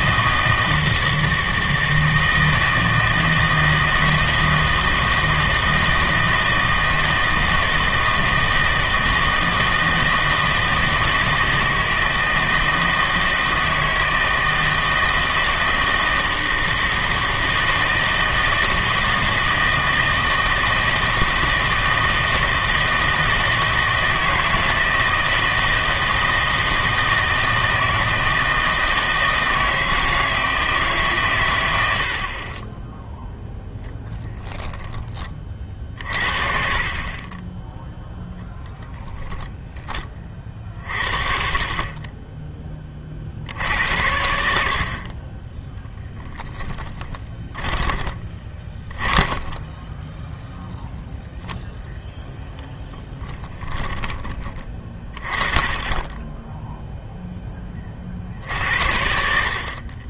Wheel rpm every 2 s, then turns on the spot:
160, 160, 160, 160, 160, 160, 160, 160, 160, 160, 160, 160, 160, 160, 160, 160, 20, 0, 40, 10, 50, 20, 70, 10, 20, 0, 10, 20, 0, 60.
38-40 46-50